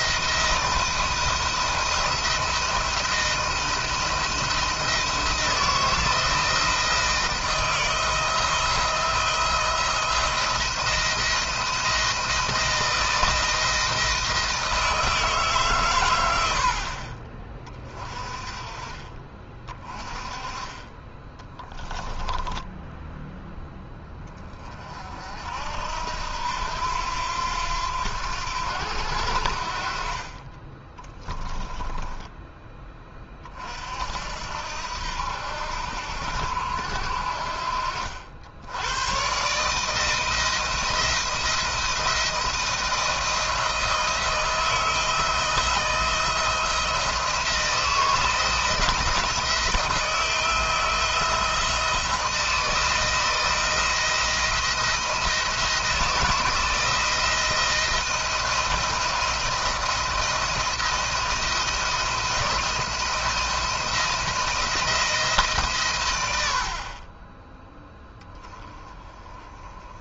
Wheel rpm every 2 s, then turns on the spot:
170, 170, 170, 160, 170, 170, 170, 160, 60, 30, 30, 10, 40, 80, 80, 20, 20, 70, 70, 100, 170, 170, 160, 170, 170, 160, 160, 170, 160, 170, 170, 170, 160, 50, 20.
22-24 30-32